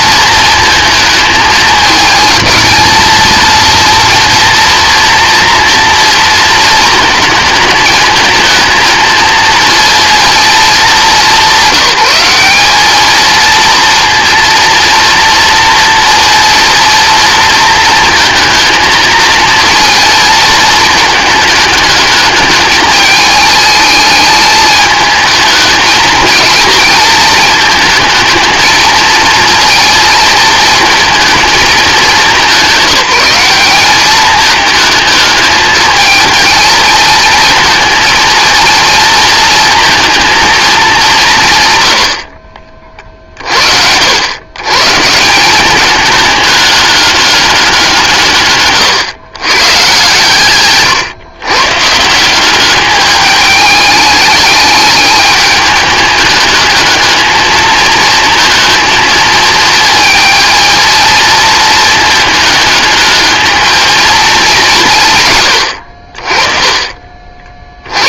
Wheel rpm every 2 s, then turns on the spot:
220, 220, 230, 220, 220, 210, 210, 230, 230, 220, 220, 210, 220, 220, 220, 230, 190, 220, 220, 230, 200, 40, 150, 200, 120, 120, 210, 210, 210, 230, 230, 220, 140, 40.
none